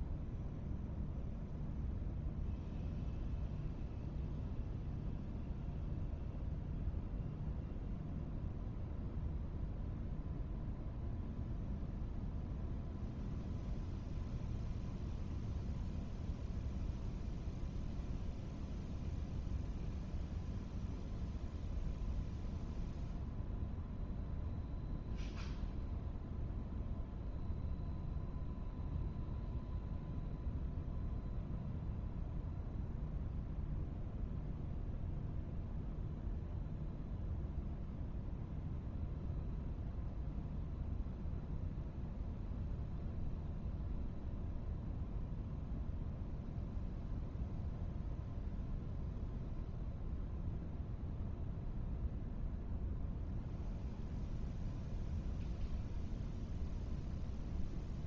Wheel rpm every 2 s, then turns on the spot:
0, 0, 0, 0, 0, 0, 0, 0, 0, 0, 0, 0, 0, 0, 0, 0, 0, 0, 0, 0, 0, 0, 0, 0, 0, 0, 0, 0, 0.
none